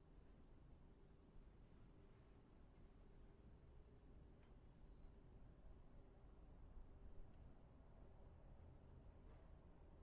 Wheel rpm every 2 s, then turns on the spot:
0, 0, 0, 0, 0.
none